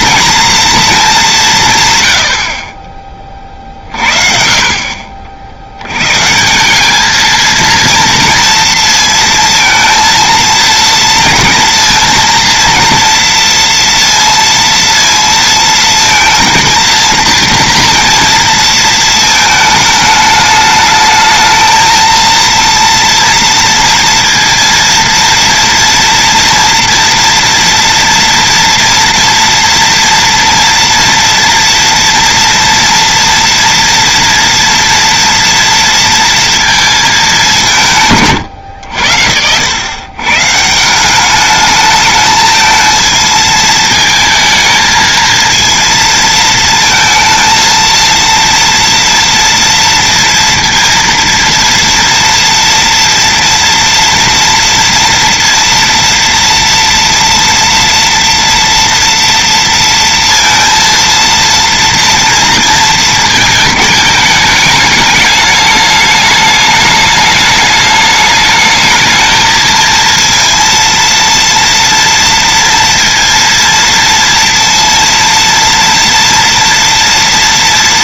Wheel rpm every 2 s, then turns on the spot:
230, 30, 40, 170, 230, 220, 230, 230, 230, 230, 210, 230, 230, 240, 230, 230, 230, 230, 230, 120, 150, 220, 220, 230, 230, 230, 230, 230, 230, 230, 230, 230, 210, 210, 210, 230, 230, 230, 230.
none